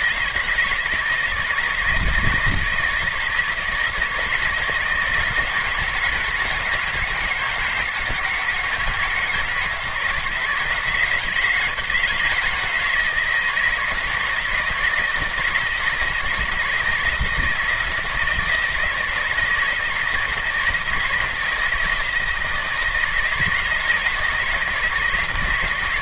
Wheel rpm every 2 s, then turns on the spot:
160, 160, 160, 160, 160, 160, 160, 160, 160, 170, 170, 160, 160.
none